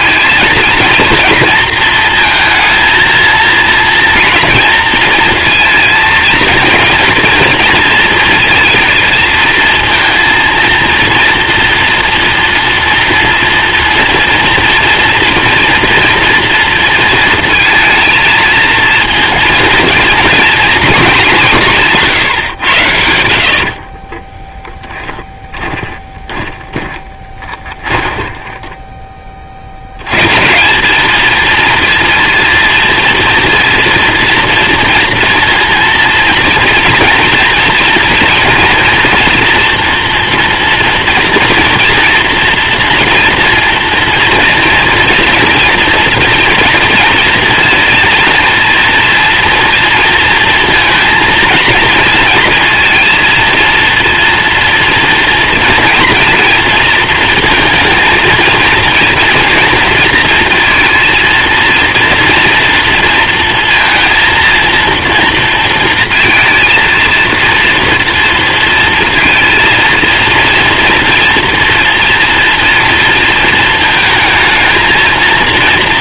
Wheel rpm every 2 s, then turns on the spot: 230, 220, 230, 230, 230, 230, 230, 230, 230, 230, 230, 110, 10, 20, 10, 170, 230, 230, 230, 230, 230, 230, 230, 240, 230, 230, 230, 230, 230, 230, 230, 230, 230, 230, 230, 230, 240, 230.
24-30